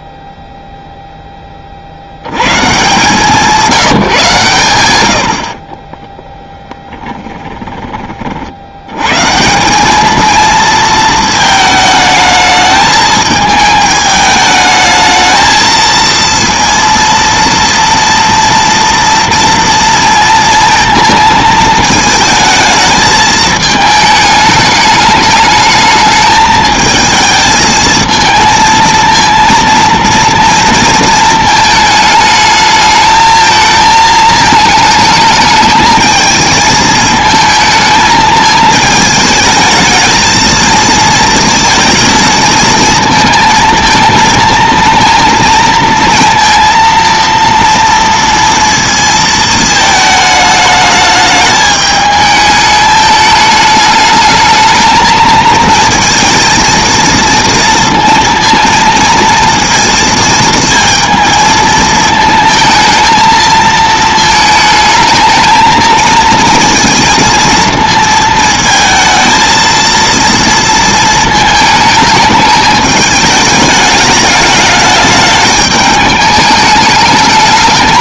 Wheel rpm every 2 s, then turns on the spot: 0, 130, 110, 10, 70, 230, 220, 210, 230, 230, 230, 220, 210, 220, 230, 230, 220, 220, 220, 220, 220, 230, 220, 230, 230, 210, 210, 220, 230, 230, 230, 230, 220, 230, 220, 230, 210, 210, 210.
6-8